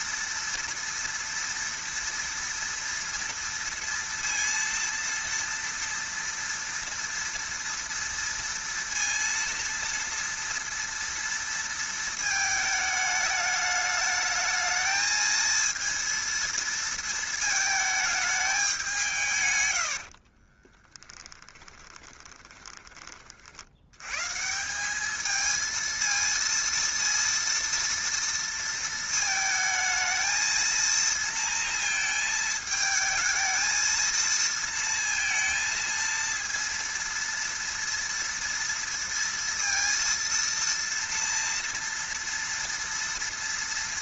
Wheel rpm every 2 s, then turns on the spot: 230, 230, 230, 230, 230, 230, 220, 220, 230, 200, 20, 20, 180, 230, 230, 230, 220, 230, 230, 230, 230, 230.
20-24